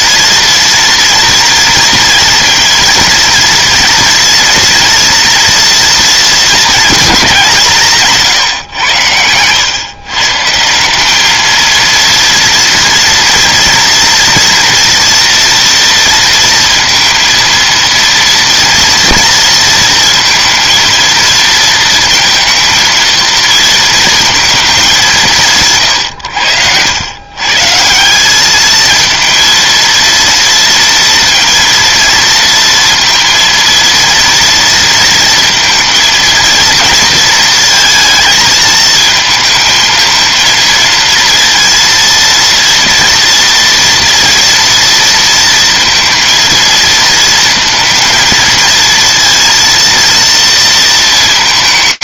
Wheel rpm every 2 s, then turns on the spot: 230, 230, 230, 200, 90, 200, 230, 230, 230, 230, 230, 230, 190, 110, 220, 230, 230, 230, 230, 220, 230, 230, 230, 220, 230, 230.
none